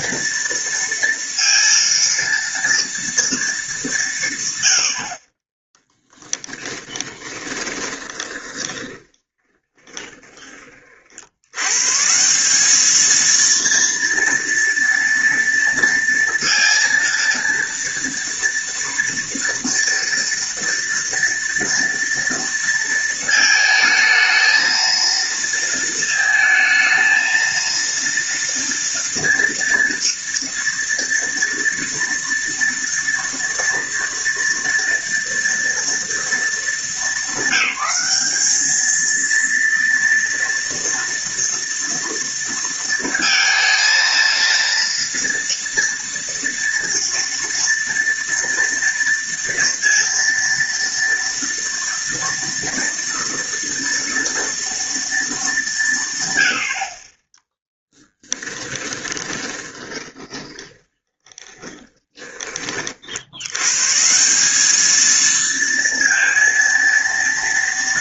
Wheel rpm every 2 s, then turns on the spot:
230, 230, 140, 20, 20, 20, 170, 230, 230, 230, 240, 230, 220, 220, 230, 230, 230, 230, 230, 210, 230, 230, 230, 230, 230, 230, 230, 230, 110, 10, 20, 20, 180, 230.
6-10 58-62